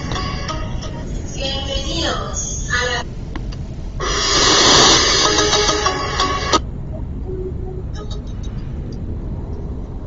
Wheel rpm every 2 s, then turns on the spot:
0, 0, 0, 0, 0.
none